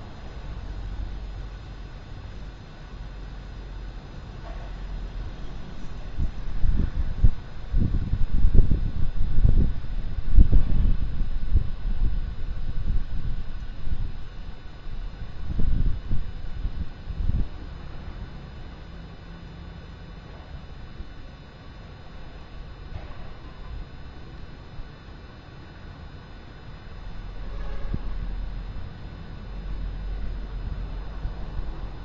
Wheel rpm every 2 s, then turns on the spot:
0, 0, 0, 0, 0, 0, 0, 0, 0, 0, 0, 0, 0, 0, 0, 0.
none